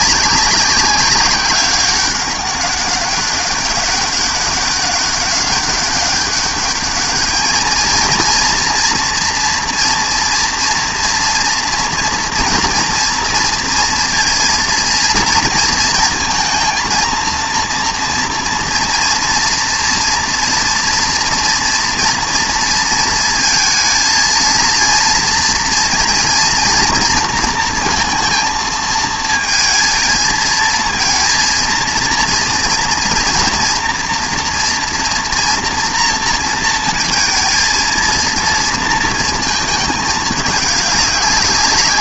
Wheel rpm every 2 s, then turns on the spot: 190, 200, 190, 200, 230, 230, 240, 230, 230, 230, 230, 230, 230, 230, 230, 230, 230, 230, 230, 230, 210.
none